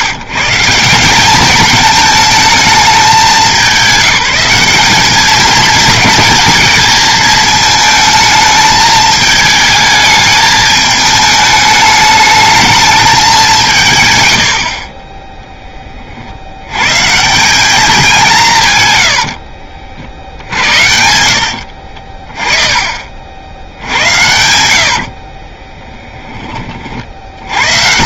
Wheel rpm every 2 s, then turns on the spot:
160, 220, 190, 220, 220, 210, 210, 80, 90, 160, 70, 30, 80, 20.
20-22 24-26